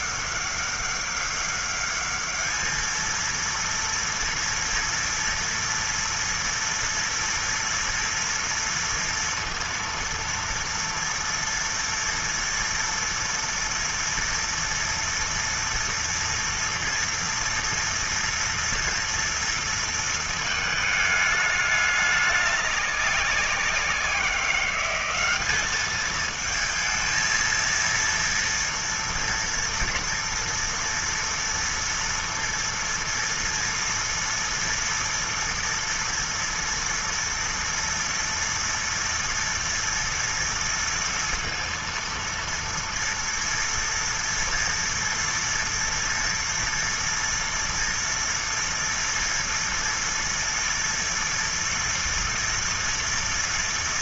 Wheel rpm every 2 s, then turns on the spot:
200, 210, 230, 230, 230, 230, 230, 230, 230, 230, 220, 200, 180, 220, 230, 230, 230, 230, 230, 240, 230, 230, 230, 230, 230, 230, 230.
none